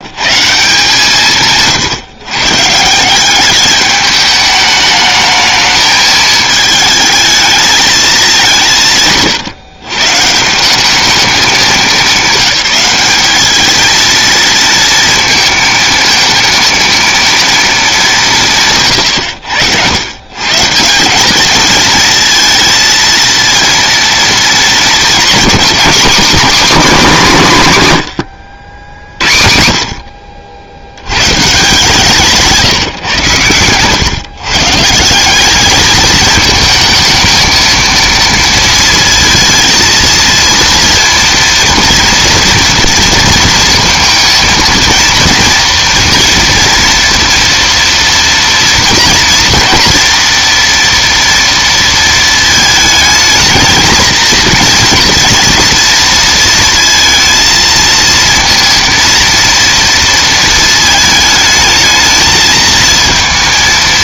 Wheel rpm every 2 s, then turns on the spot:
170, 160, 210, 210, 160, 190, 190, 230, 230, 130, 170, 230, 230, 240, 80, 80, 150, 150, 220, 230, 230, 230, 230, 240, 230, 230, 220, 230, 230, 230, 220, 220.
none